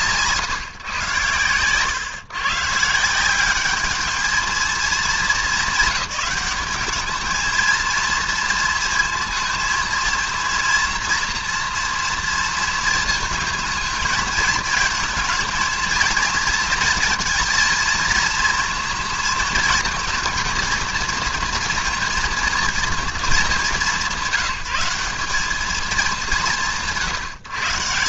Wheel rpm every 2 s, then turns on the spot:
130, 150, 220, 210, 230, 230, 230, 230, 230, 230, 220, 230, 170, 140.
none